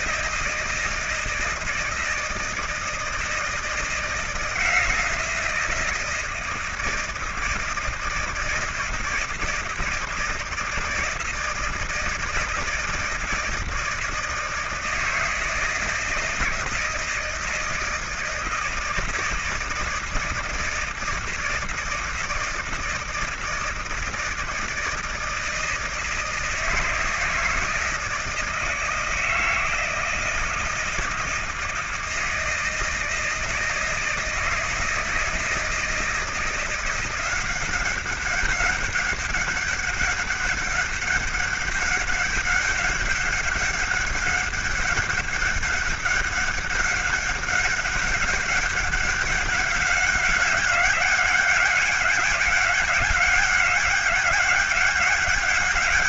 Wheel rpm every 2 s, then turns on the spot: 170, 160, 160, 160, 160, 160, 160, 160, 160, 160, 160, 160, 160, 160, 160, 160, 160, 160, 170, 190, 200, 200, 200, 200, 200, 190, 200, 200.
none